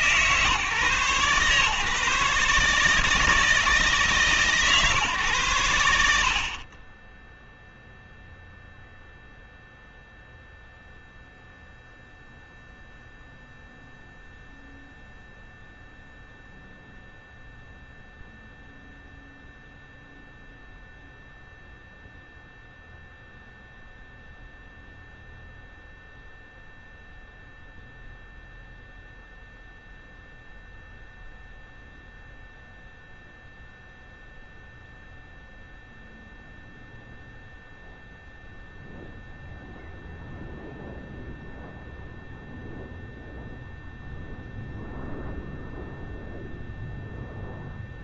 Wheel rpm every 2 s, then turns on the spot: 140, 150, 140, 30, 0, 0, 0, 0, 0, 0, 0, 0, 0, 0, 0, 0, 0, 0, 0, 0, 0, 0, 0, 0.
none